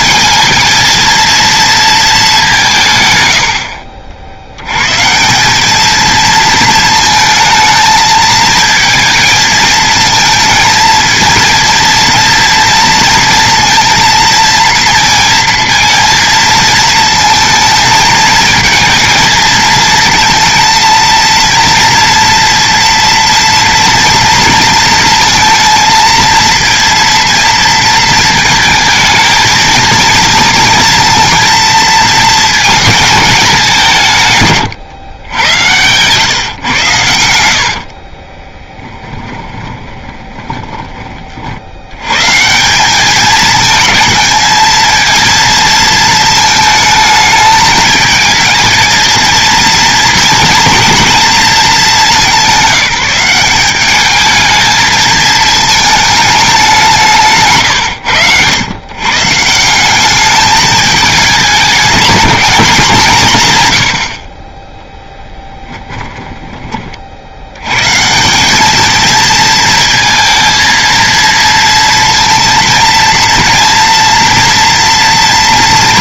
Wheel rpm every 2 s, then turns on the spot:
220, 170, 110, 220, 220, 230, 230, 230, 220, 230, 230, 230, 230, 230, 220, 230, 220, 130, 120, 10, 20, 180, 220, 220, 230, 230, 190, 220, 200, 120, 220, 190, 10, 30, 210, 230, 230, 230.
34-36 38-42